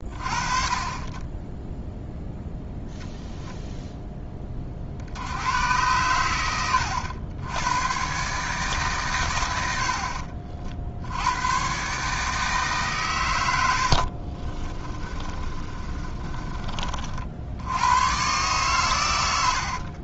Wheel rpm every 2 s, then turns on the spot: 50, 0, 50, 90, 130, 70, 140, 30, 40, 110.
14-16